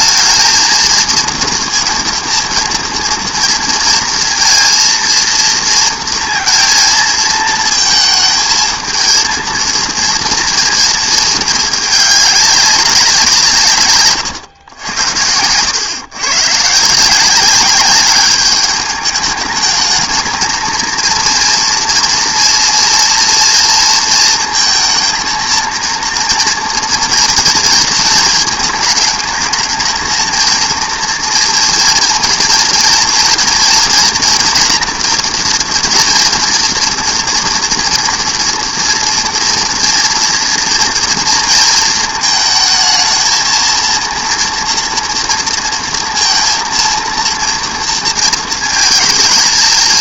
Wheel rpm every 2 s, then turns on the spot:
220, 230, 230, 230, 220, 230, 190, 110, 140, 200, 220, 230, 230, 230, 220, 230, 230, 230, 230, 230, 230, 220, 230, 230, 230.
none